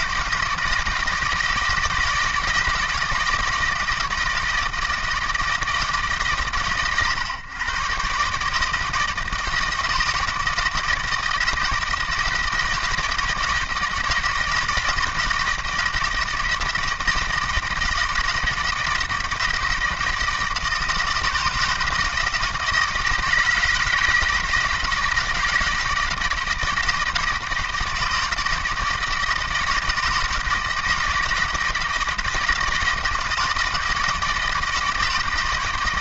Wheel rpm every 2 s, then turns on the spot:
160, 160, 160, 110, 150, 160, 160, 160, 160, 160, 160, 160, 160, 170, 160, 170, 160, 160.
none